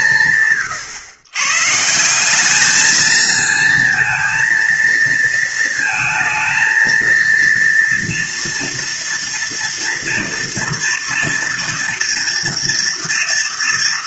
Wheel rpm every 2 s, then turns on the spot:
140, 220, 230, 230, 230, 240, 230.
none